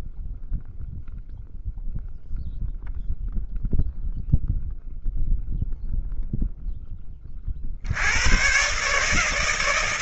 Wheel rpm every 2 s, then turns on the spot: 0, 0, 0, 10, 130.
none